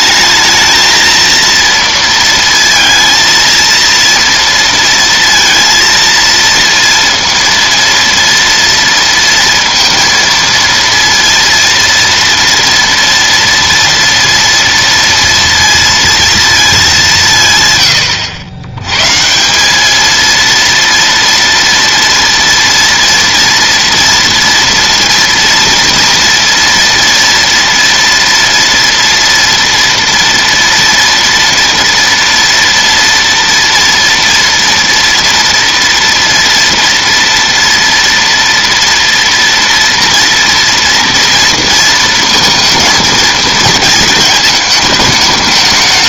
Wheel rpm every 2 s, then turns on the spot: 230, 230, 230, 230, 230, 230, 230, 230, 200, 110, 230, 230, 230, 230, 230, 230, 230, 230, 240, 230, 230, 220, 210.
none